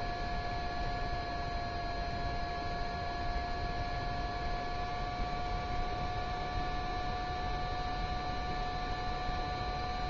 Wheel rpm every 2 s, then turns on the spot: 0, 0, 0, 0, 0.
none